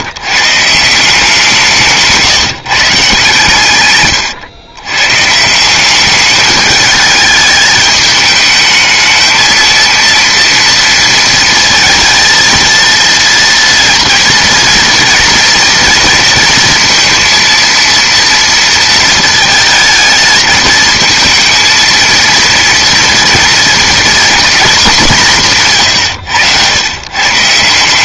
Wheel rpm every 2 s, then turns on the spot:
150, 160, 120, 210, 220, 240, 230, 230, 230, 230, 220, 230, 220, 100.
none